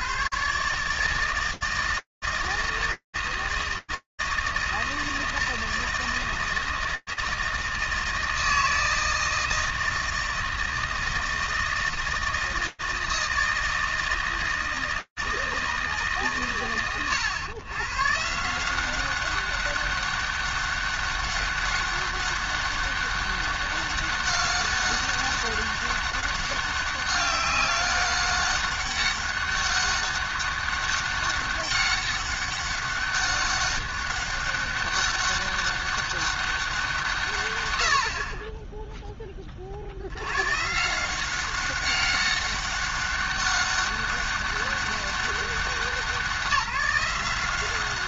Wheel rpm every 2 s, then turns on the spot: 150, 160, 160, 160, 160, 160, 160, 160, 120, 200, 200, 200, 200, 200, 200, 200, 200, 200, 80, 60, 190, 200, 190, 190.
none